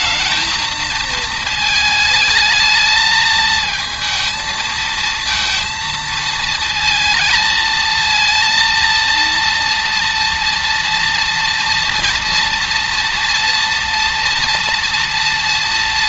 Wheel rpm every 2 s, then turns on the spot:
220, 220, 220, 230, 230, 230, 230, 230.
none